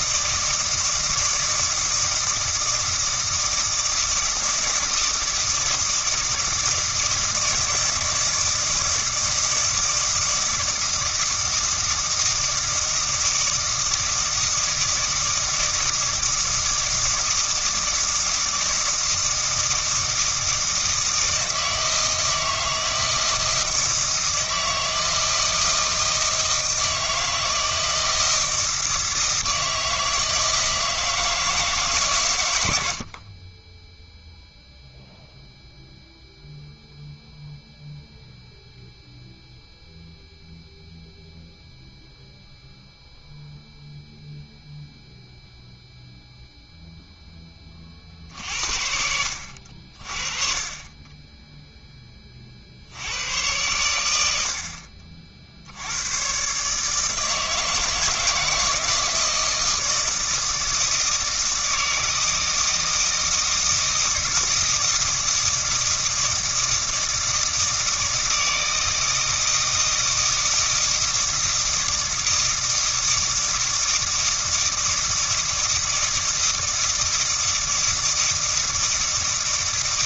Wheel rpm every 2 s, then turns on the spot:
160, 160, 160, 160, 160, 160, 160, 160, 160, 160, 160, 160, 160, 160, 160, 160, 70, 0, 0, 0, 0, 0, 0, 0, 60, 30, 60, 60, 150, 160, 160, 160, 160, 160, 160, 160, 160, 160, 160, 160.
none